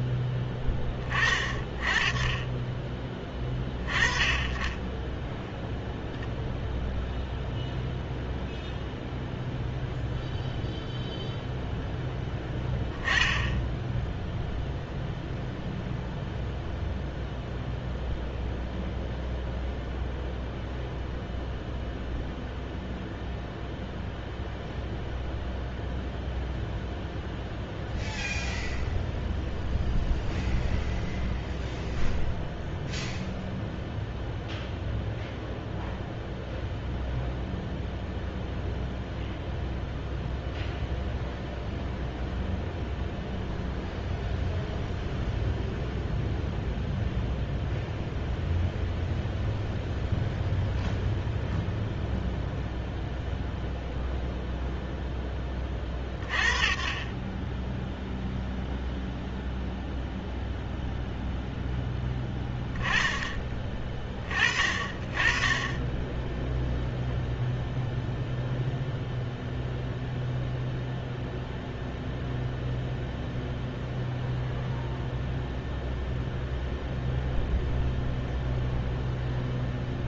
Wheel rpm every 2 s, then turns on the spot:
10, 20, 10, 0, 0, 0, 10, 0, 0, 0, 0, 0, 0, 0, 0, 0, 0, 0, 0, 0, 0, 0, 0, 0, 0, 0, 0, 0, 30, 0, 0, 10, 30, 0, 0, 0, 0, 0, 0, 0.
none